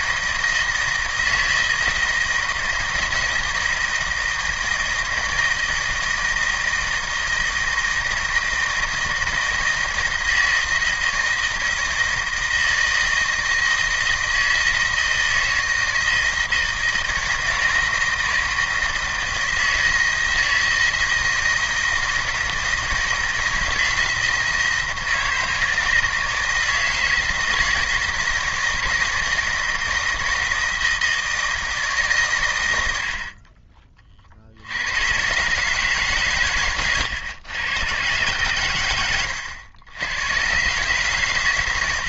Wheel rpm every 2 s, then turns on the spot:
160, 160, 160, 160, 160, 160, 160, 160, 160, 160, 160, 160, 160, 160, 160, 160, 110, 70, 130, 110, 110.
none